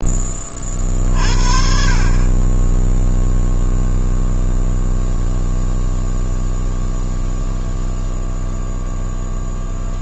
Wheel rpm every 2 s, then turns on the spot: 50, 0, 0, 0, 0.
none